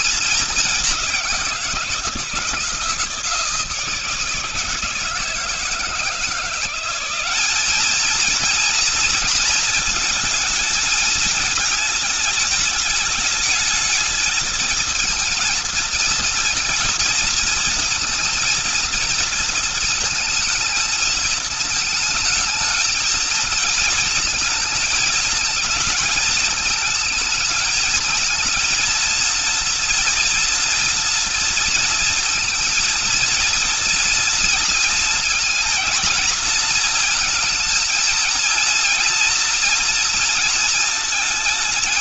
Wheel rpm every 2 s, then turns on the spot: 210, 160, 160, 180, 230, 220, 210, 220, 230, 230, 220, 220, 220, 220, 230, 230, 230, 230, 230, 230, 230.
none